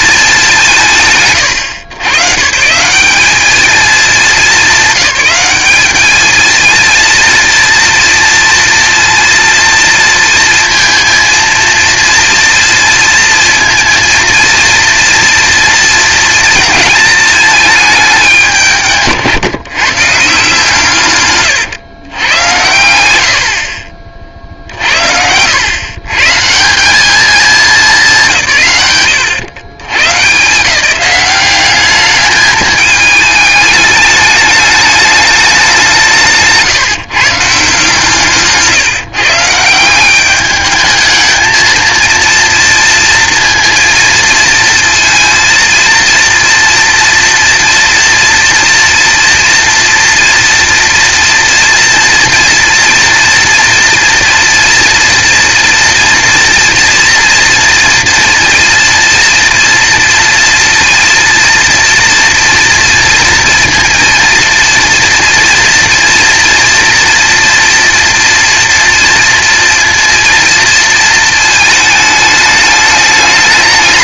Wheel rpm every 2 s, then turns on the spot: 190, 150, 210, 220, 230, 230, 230, 230, 230, 160, 150, 100, 60, 160, 160, 170, 210, 210, 150, 150, 210, 230, 230, 230, 230, 230, 230, 230, 240, 230, 230, 230, 230, 230, 230, 230, 210.
none